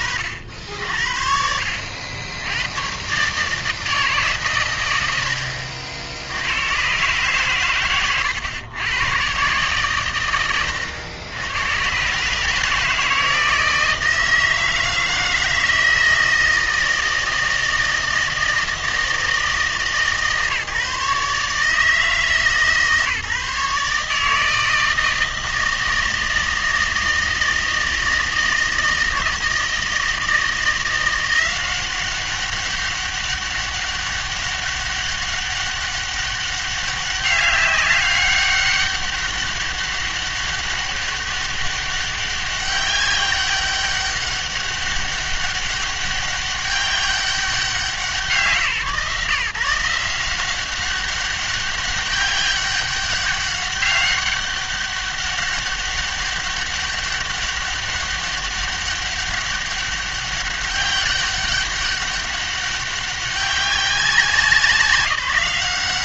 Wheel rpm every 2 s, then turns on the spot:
70, 100, 120, 90, 110, 100, 160, 160, 160, 160, 140, 150, 160, 160, 160, 170, 190, 200, 200, 200, 200, 200, 200, 200, 160, 190, 200, 200, 200, 200, 200, 190, 190.
none